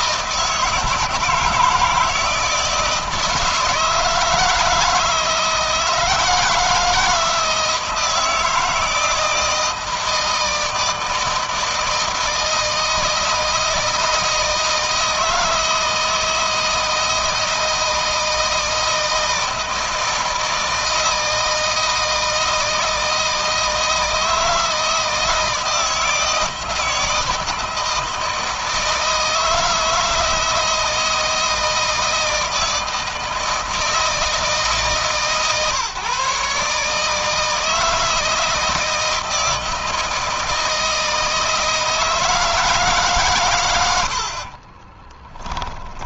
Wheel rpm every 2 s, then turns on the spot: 150, 160, 160, 160, 160, 160, 160, 160, 160, 160, 160, 160, 160, 160, 160, 160, 160, 150, 150, 160, 160, 150, 20.
44-46